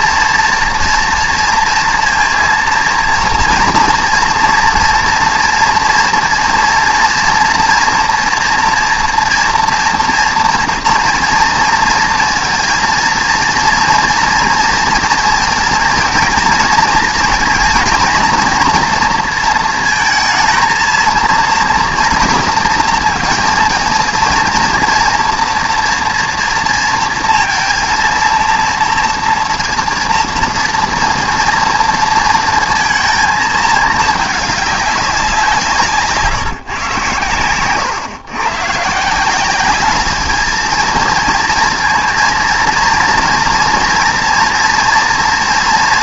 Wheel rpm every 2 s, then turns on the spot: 230, 230, 230, 230, 230, 230, 230, 230, 230, 240, 230, 230, 230, 230, 240, 230, 230, 200, 150, 130, 230, 230, 230.
none